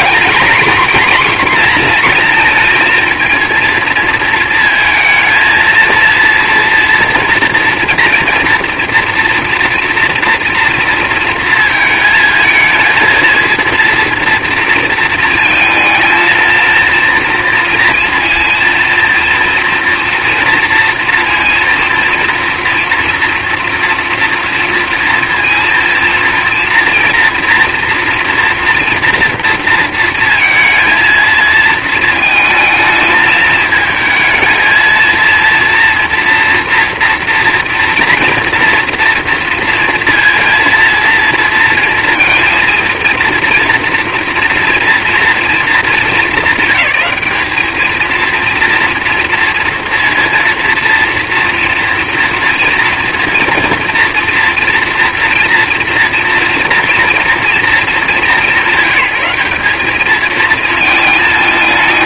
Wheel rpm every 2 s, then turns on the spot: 250, 230, 230, 230, 240, 230, 220, 230, 230, 230, 230, 230, 230, 240, 240, 230, 220, 220, 230, 240, 230, 230, 230, 210, 230, 230, 230, 230, 230, 180, 220.
none